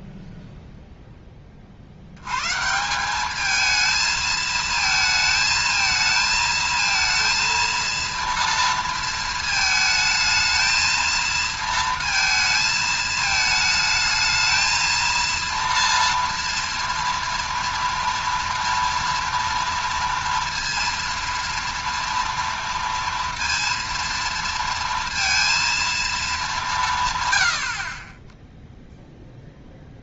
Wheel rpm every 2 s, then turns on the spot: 0, 140, 220, 220, 230, 220, 220, 220, 230, 230, 230, 230, 230, 220, 0.
none